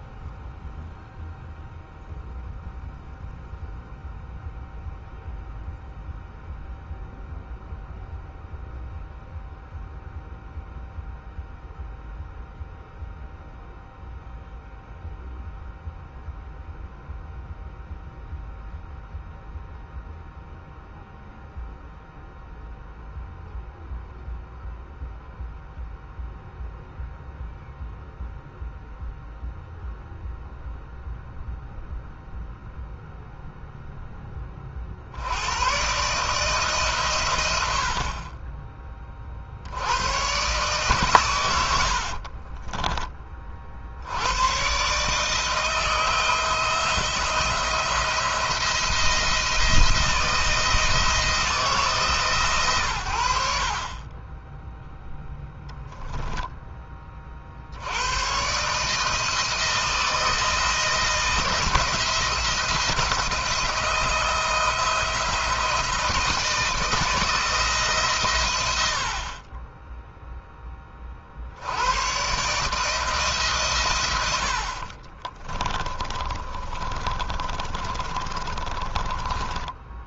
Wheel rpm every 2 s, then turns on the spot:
0, 0, 0, 0, 0, 0, 0, 0, 0, 0, 0, 0, 0, 0, 0, 0, 0, 80, 120, 50, 110, 30, 150, 170, 170, 160, 80, 0, 20, 150, 160, 170, 160, 170, 70, 20, 150, 50, 30, 20.
74-80